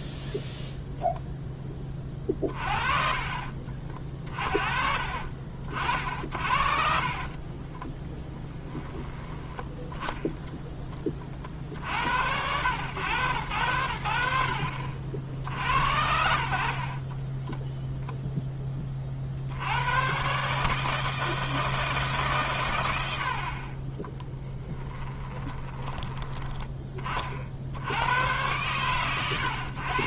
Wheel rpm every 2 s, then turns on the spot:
0, 30, 40, 40, 10, 40, 100, 60, 30, 20, 150, 100, 10, 20, 110.
2-4 6-10 24-26